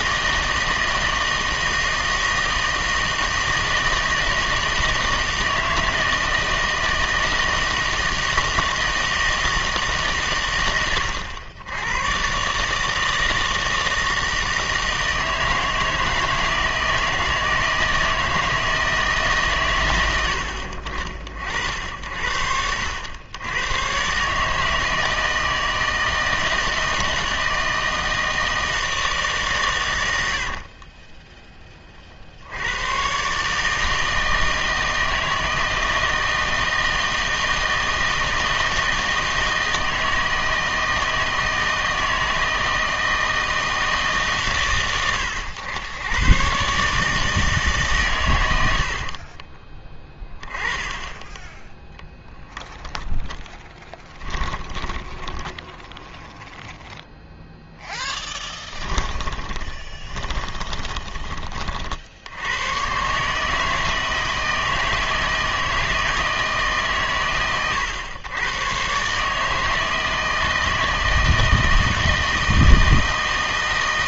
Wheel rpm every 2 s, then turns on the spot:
160, 160, 160, 160, 160, 110, 150, 160, 160, 160, 70, 80, 150, 160, 160, 50, 90, 160, 160, 160, 160, 160, 130, 140, 90, 10, 10, 10, 0, 10, 20, 110, 160, 150, 120, 160, 160.
30-32 54-56 58-62